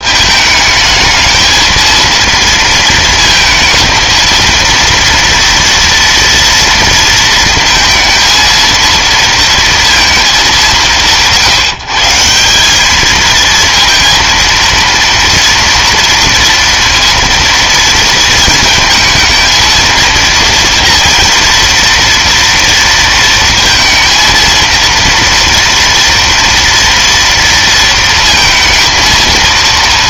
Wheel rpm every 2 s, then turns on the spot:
220, 220, 230, 230, 230, 180, 210, 230, 230, 230, 230, 230, 230, 230, 230.
none